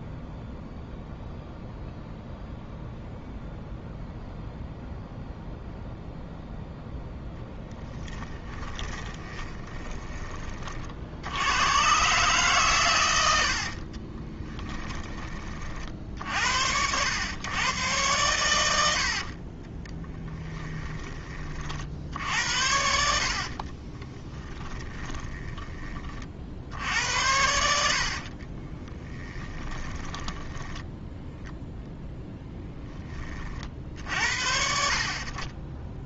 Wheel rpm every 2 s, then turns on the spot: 0, 0, 0, 0, 20, 40, 120, 10, 80, 80, 20, 60, 30, 70, 10, 10, 10, 60.
8-10 22-26 28-32